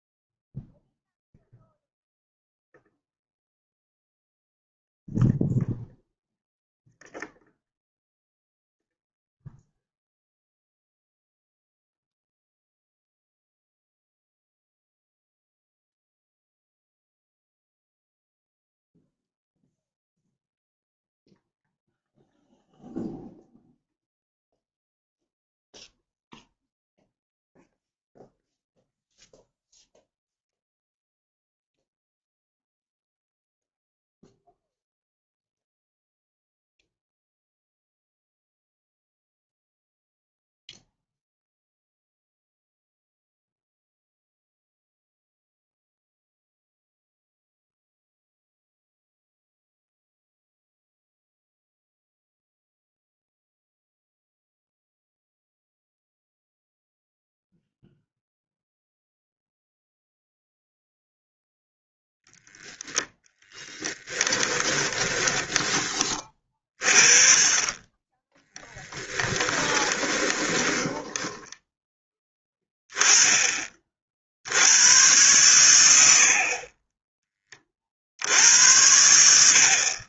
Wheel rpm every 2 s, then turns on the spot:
0, 0, 0, 0, 0, 0, 0, 0, 0, 0, 0, 0, 0, 0, 0, 0, 0, 0, 0, 0, 0, 0, 0, 0, 0, 0, 0, 0, 0, 0, 0, 0, 20, 40, 10, 10, 10, 100, 20, 80.
64-66 68-72